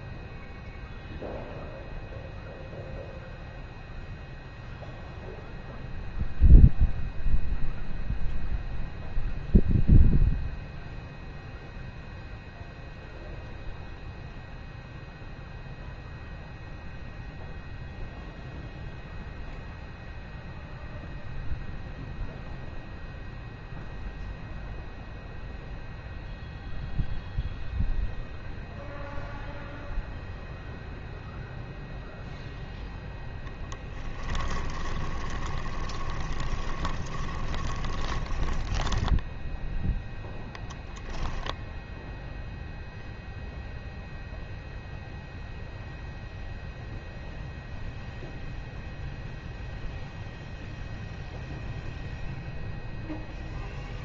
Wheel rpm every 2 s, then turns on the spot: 0, 0, 0, 0, 0, 0, 0, 0, 0, 0, 0, 0, 0, 0, 0, 0, 0, 20, 20, 10, 10, 0, 0, 0, 0, 0, 0.
34-40